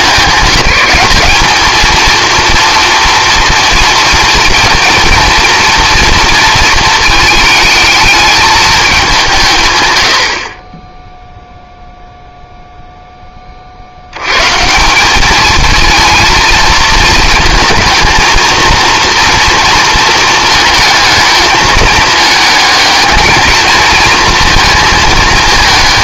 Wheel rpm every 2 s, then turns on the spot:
200, 230, 230, 230, 210, 30, 0, 150, 230, 230, 220, 210, 220.
none